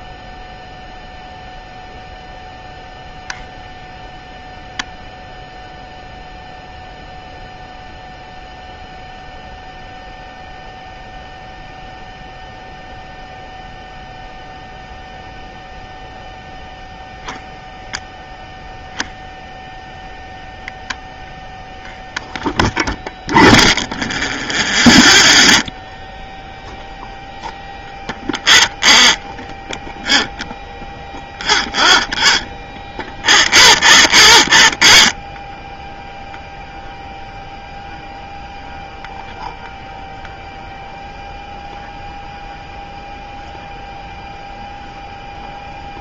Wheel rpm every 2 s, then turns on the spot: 0, 0, 0, 0, 0, 0, 0, 0, 0, 0, 0, 0, 0, 0, 0, 0, 0, 0, 0, 0, 0, 0, 0.
none